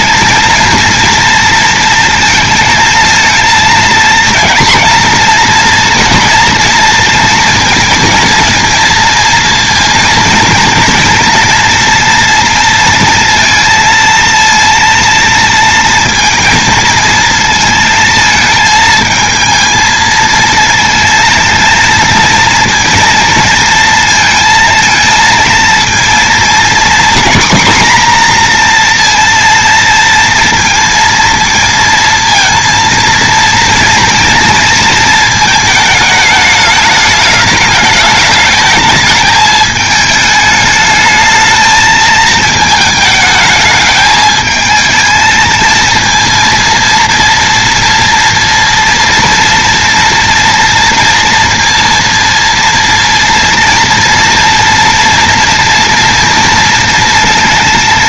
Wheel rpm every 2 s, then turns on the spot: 230, 230, 230, 230, 230, 230, 230, 230, 220, 220, 220, 230, 230, 240, 240, 230, 230, 230, 210, 210, 220, 220, 220, 230, 230, 240, 230, 230, 230.
none